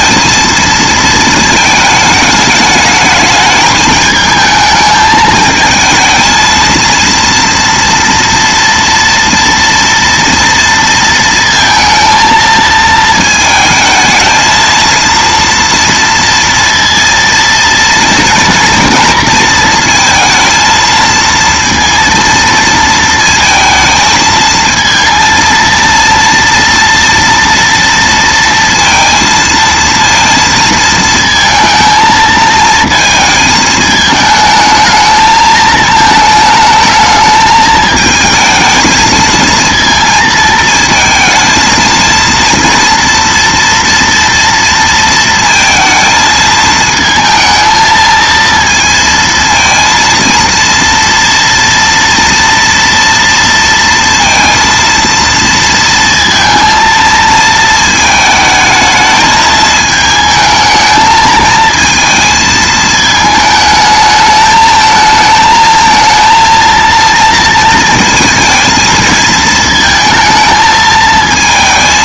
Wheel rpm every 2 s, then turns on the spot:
230, 210, 220, 230, 230, 230, 220, 230, 230, 230, 230, 230, 230, 230, 230, 230, 220, 220, 220, 220, 220, 230, 230, 220, 230, 230, 230, 230, 230, 220, 220, 220, 220, 230, 230, 220.
none